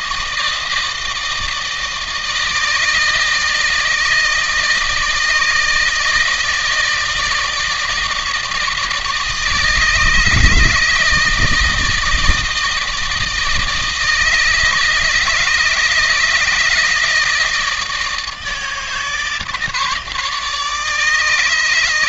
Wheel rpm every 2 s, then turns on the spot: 160, 160, 160, 160, 160, 150, 160, 160, 160, 160, 150.
none